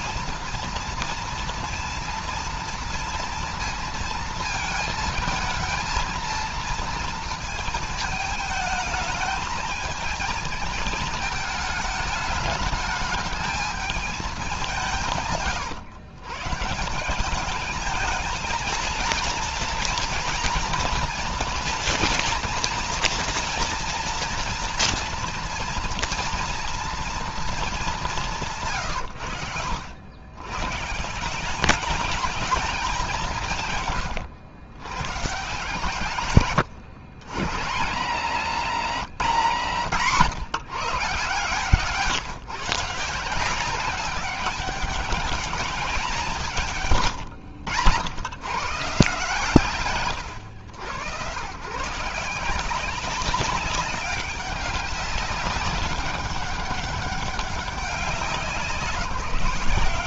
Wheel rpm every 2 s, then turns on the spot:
230, 230, 230, 230, 220, 220, 210, 200, 140, 220, 230, 230, 230, 230, 170, 110, 210, 120, 130, 180, 160, 140, 190, 160, 110, 100, 170, 200, 200, 190.
none